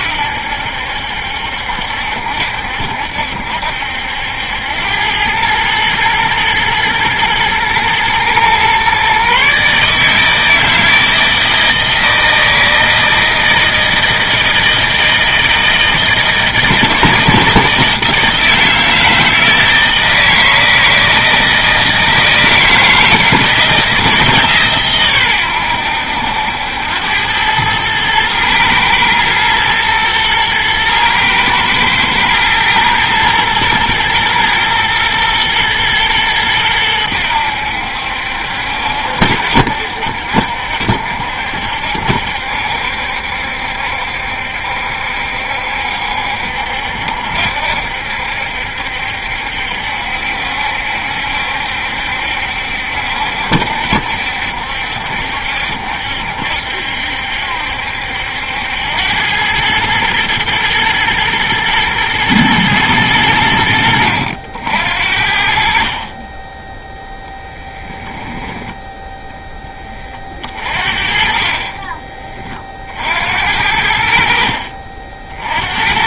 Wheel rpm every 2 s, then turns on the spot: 70, 70, 90, 110, 130, 160, 160, 160, 160, 160, 160, 160, 140, 90, 110, 110, 110, 120, 100, 70, 60, 70, 70, 70, 70, 70, 70, 70, 70, 90, 120, 110, 70, 10, 10, 40, 40, 50.
68-70